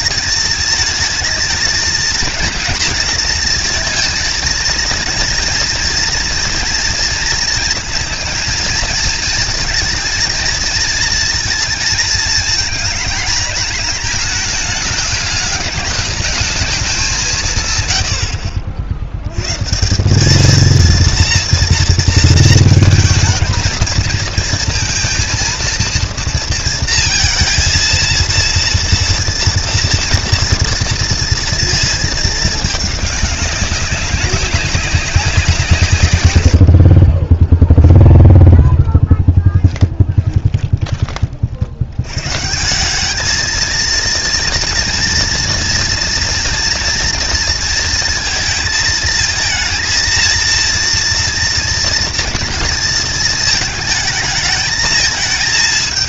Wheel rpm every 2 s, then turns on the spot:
220, 230, 230, 230, 230, 230, 220, 210, 190, 80, 230, 220, 230, 230, 230, 230, 210, 190, 50, 10, 20, 190, 230, 230, 220, 230, 230, 220.
38-40